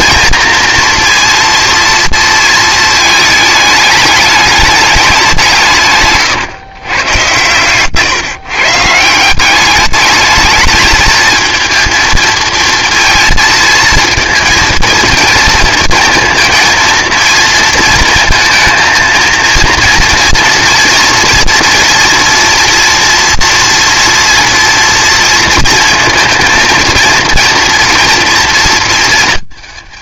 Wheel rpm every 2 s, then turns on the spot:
230, 230, 210, 140, 150, 220, 230, 230, 230, 220, 230, 240, 230, 230, 230.
none